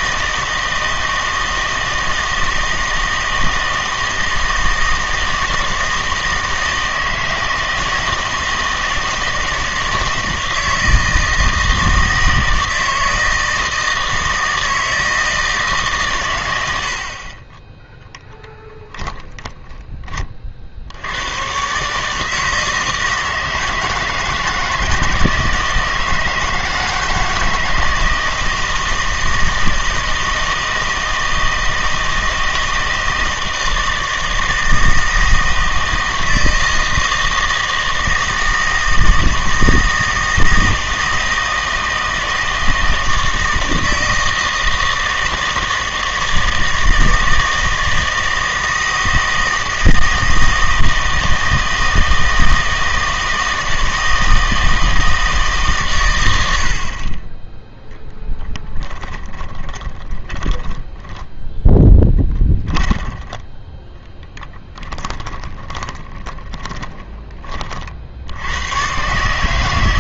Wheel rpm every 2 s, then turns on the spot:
160, 160, 160, 160, 160, 160, 160, 160, 110, 10, 50, 160, 160, 160, 160, 160, 160, 160, 160, 160, 160, 160, 160, 160, 160, 160, 160, 160, 60, 20, 10, 10, 10, 10, 90.
58-68